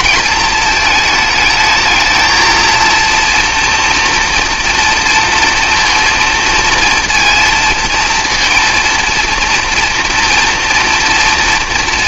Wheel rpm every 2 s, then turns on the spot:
220, 230, 230, 230, 230, 230.
none